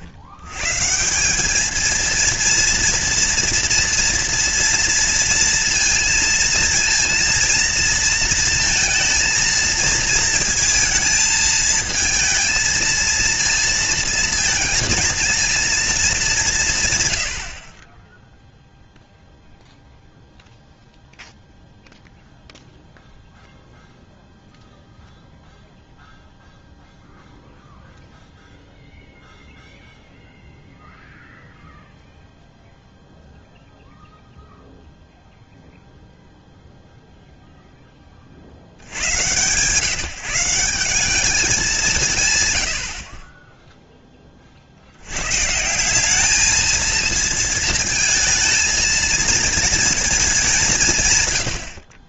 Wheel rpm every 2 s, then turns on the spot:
100, 230, 230, 230, 230, 220, 230, 220, 160, 0, 0, 0, 0, 0, 0, 0, 0, 0, 0, 100, 190, 70, 60, 220, 230, 150.
none